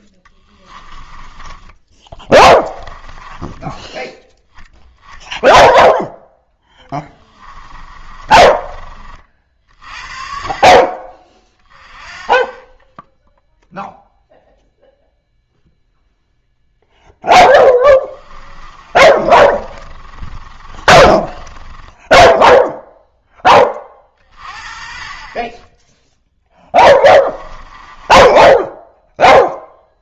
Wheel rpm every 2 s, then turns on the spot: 20, 10, 10, 20, 30, 30, 10, 0, 0, 30, 30, 0, 40, 10, 10.
0-4 6-8 18-22 26-30